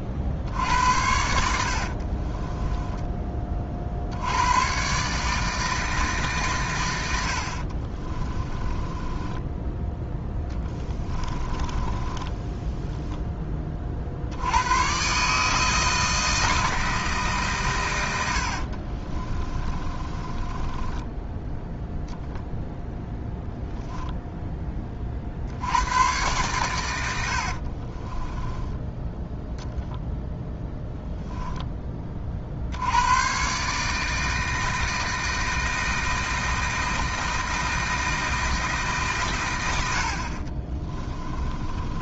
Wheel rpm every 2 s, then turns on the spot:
80, 20, 120, 120, 20, 30, 10, 110, 160, 50, 20, 10, 20, 110, 10, 0, 70, 160, 160, 150, 30.
2-4 8-14 18-22 28-30 40-42